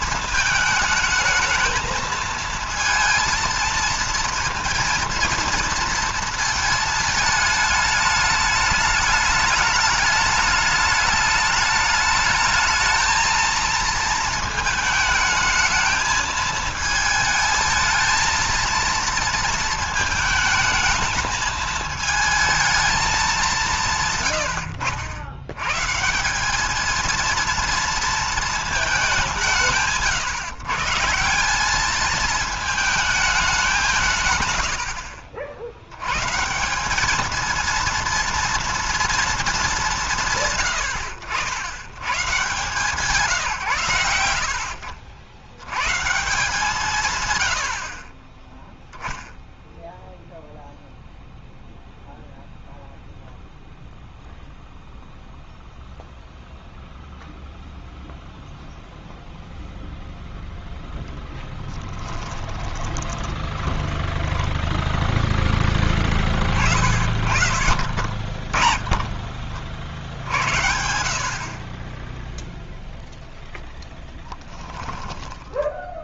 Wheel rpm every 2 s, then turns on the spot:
220, 230, 230, 230, 210, 210, 220, 220, 220, 230, 220, 220, 100, 200, 220, 150, 220, 110, 170, 230, 130, 140, 70, 150, 10, 0, 0, 0, 0, 0, 0, 10, 20, 40, 40, 70, 0, 10.
62-64 74-76